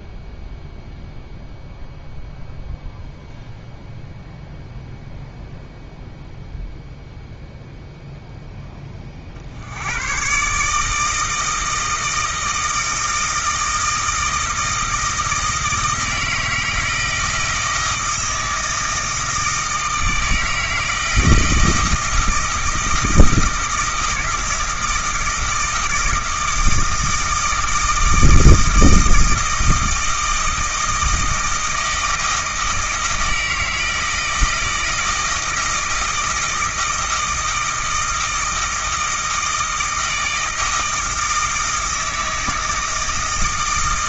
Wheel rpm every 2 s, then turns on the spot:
0, 0, 0, 0, 10, 140, 160, 160, 160, 160, 160, 160, 160, 160, 160, 160, 160, 160, 160, 160, 160, 160.
none